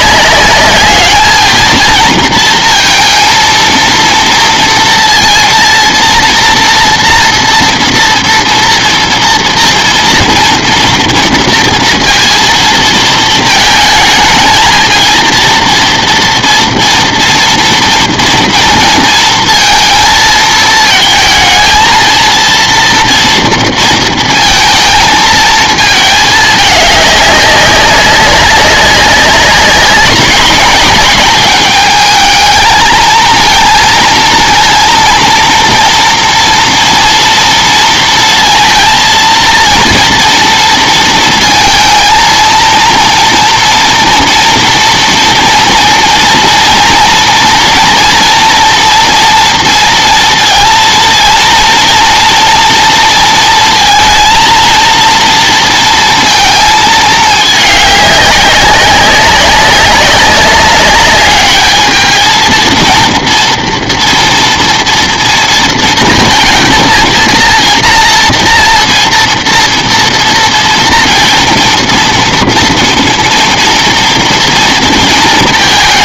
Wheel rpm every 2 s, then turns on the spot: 200, 220, 240, 240, 230, 230, 230, 220, 230, 230, 220, 230, 230, 210, 190, 210, 220, 230, 230, 230, 230, 230, 230, 230, 230, 230, 230, 230, 220, 200, 200, 230, 230, 230, 230, 230, 230, 230.
none